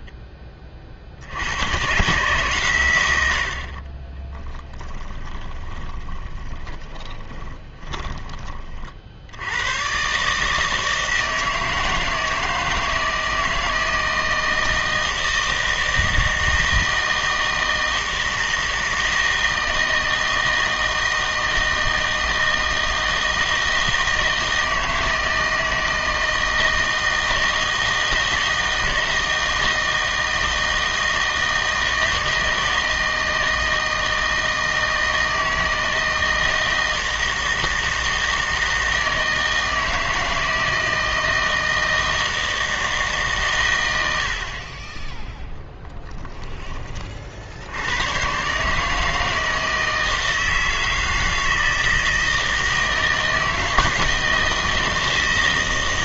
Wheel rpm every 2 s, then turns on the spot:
30, 130, 10, 20, 30, 160, 160, 160, 160, 160, 160, 160, 160, 160, 160, 160, 160, 160, 160, 160, 160, 160, 30, 10, 140, 160, 160, 160.
4-8